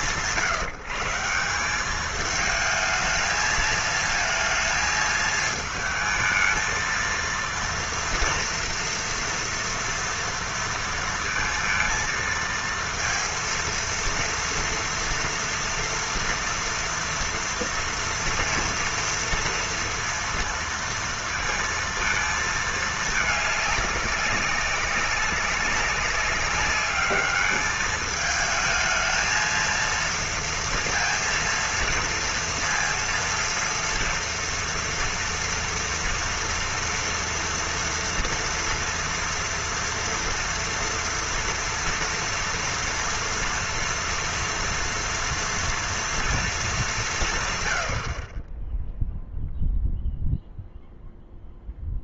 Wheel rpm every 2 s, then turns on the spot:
150, 210, 230, 220, 230, 230, 230, 230, 230, 230, 230, 230, 200, 200, 210, 230, 230, 230, 230, 230, 230, 230, 240, 230, 110, 0.
none